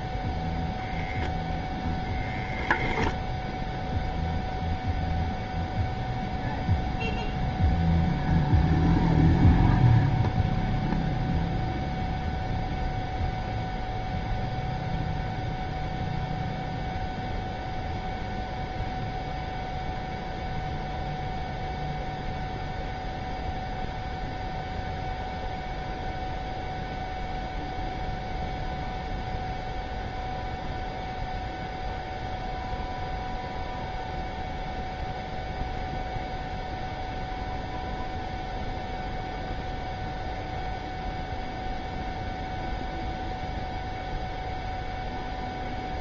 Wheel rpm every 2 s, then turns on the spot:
0, 0, 0, 0, 0, 0, 0, 0, 0, 0, 0, 0, 0, 0, 0, 0, 0, 0, 0, 0, 0, 0, 0.
none